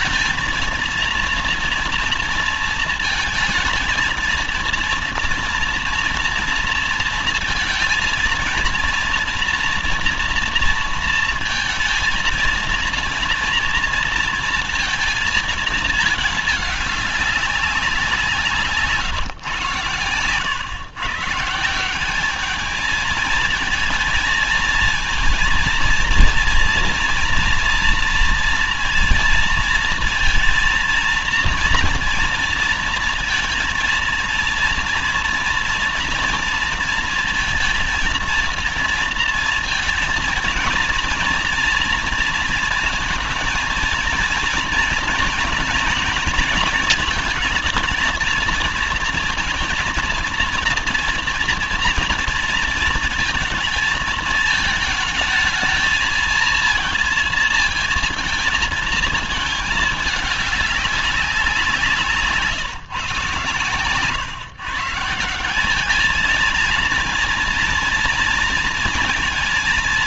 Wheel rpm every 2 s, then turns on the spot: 230, 230, 230, 230, 230, 230, 230, 230, 210, 180, 130, 210, 230, 230, 230, 230, 230, 230, 230, 230, 230, 230, 230, 220, 220, 230, 220, 220, 230, 220, 200, 150, 140, 230, 230.
none